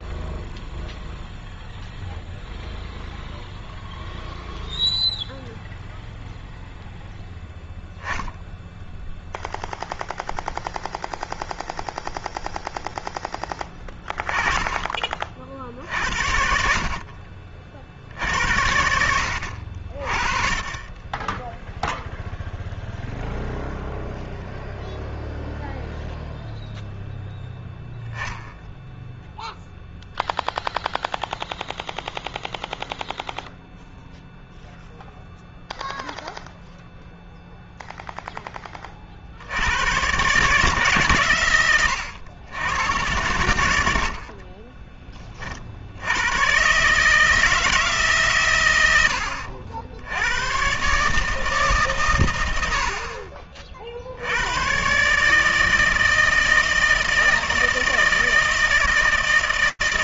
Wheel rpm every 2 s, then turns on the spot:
0, 0, 0, 0, 0, 0, 0, 30, 50, 70, 20, 0, 0, 0, 0, 0, 0, 0, 0, 40, 140, 100, 20, 150, 90, 130, 50, 120, 160, 160.
none